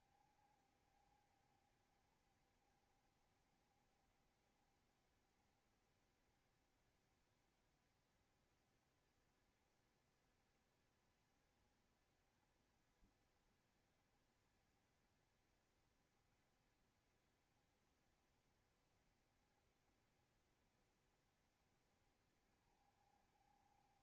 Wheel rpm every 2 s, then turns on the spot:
60, 60, 60, 70, 70, 70, 70, 70, 70, 70, 60, 60.
none